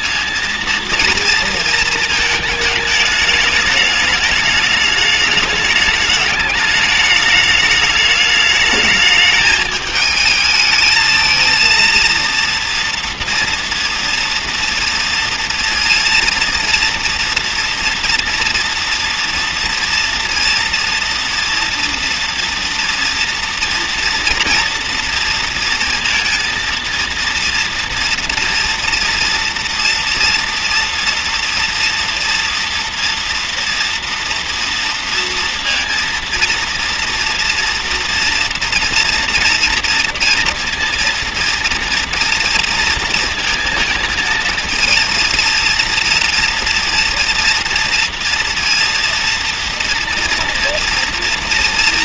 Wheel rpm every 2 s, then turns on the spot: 230, 220, 210, 210, 210, 220, 230, 230, 230, 230, 230, 240, 230, 230, 230, 230, 230, 230, 230, 230, 230, 230, 230, 230, 230, 230.
none